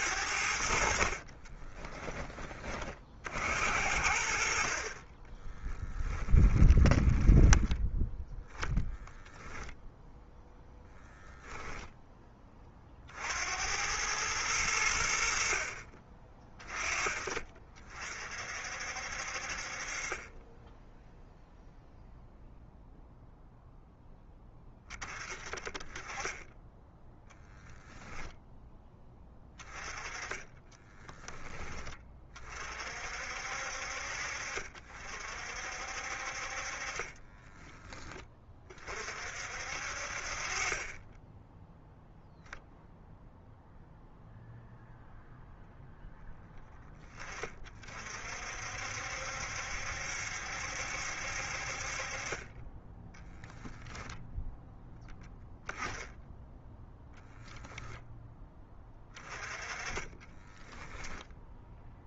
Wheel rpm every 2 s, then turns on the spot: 60, 30, 50, 10, 0, 0, 40, 110, 30, 60, 10, 0, 30, 10, 10, 20, 50, 50, 40, 40, 40, 0, 0, 20, 60, 70, 20, 0, 0, 10, 10.
0-2 6-8 30-32